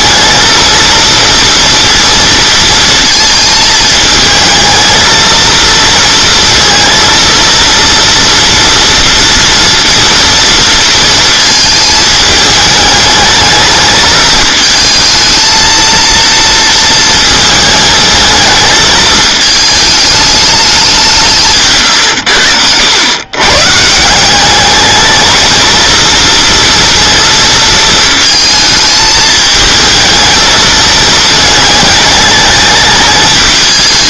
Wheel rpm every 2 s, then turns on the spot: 230, 230, 220, 230, 230, 230, 210, 220, 230, 220, 200, 90, 210, 230, 220, 220, 210.
22-24